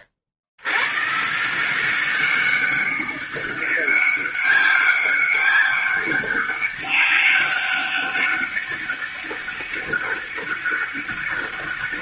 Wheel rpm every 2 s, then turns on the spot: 100, 190, 200, 200, 200, 200.
none